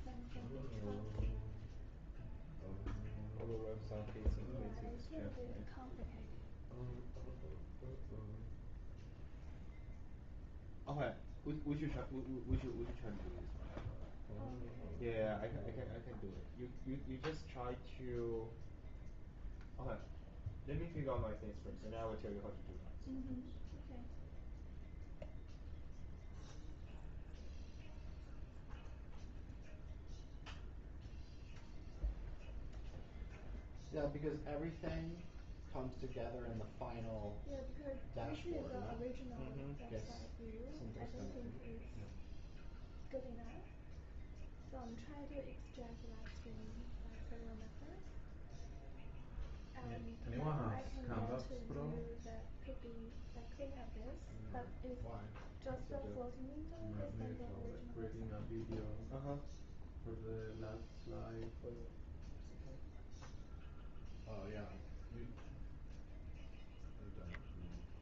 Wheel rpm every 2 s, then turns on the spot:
0, 0, 0, 0, 0, 0, 0, 0, 0, 0, 0, 0, 0, 0, 0, 0, 0, 0, 0, 0, 0, 0, 0, 0, 0, 0, 0, 0, 0, 0, 0, 0, 0, 0.
none